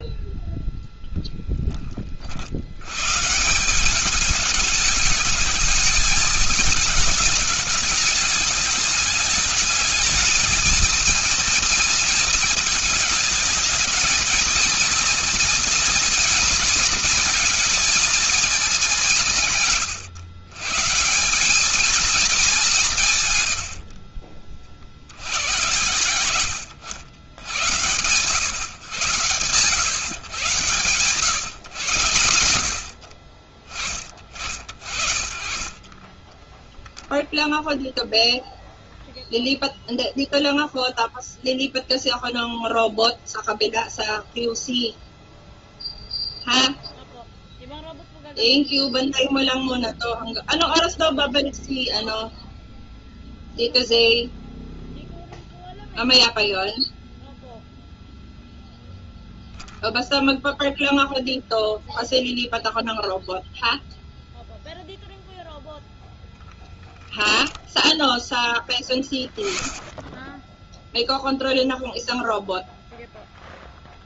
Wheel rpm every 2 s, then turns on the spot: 10, 170, 220, 210, 210, 230, 220, 230, 220, 140, 190, 120, 100, 90, 110, 130, 40, 40, 0, 0, 0, 0, 0, 0, 0, 0, 0, 0, 0, 0, 0, 0, 0, 0, 10, 0, 0.
22-24